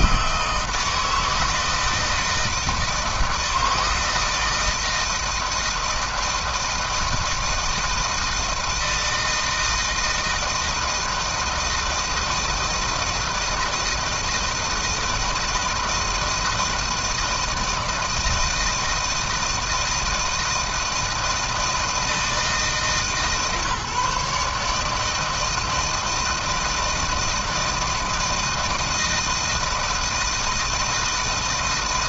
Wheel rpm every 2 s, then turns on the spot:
160, 160, 160, 160, 160, 160, 160, 170, 160, 160, 160, 150, 150, 160, 160, 160.
none